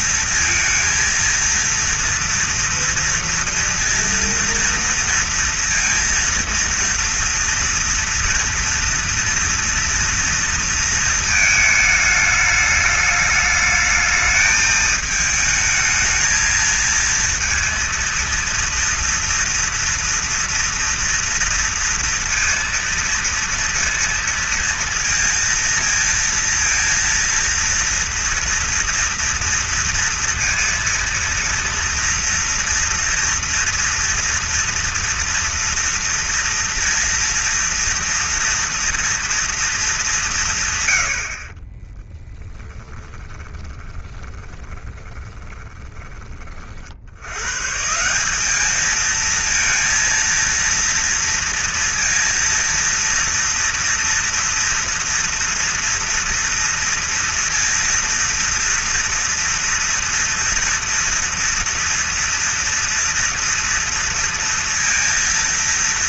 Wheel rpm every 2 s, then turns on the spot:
230, 230, 230, 230, 240, 230, 210, 220, 230, 230, 230, 230, 230, 230, 230, 230, 230, 230, 230, 230, 90, 20, 20, 70, 210, 230, 230, 230, 230, 230, 230, 230, 230.
42-46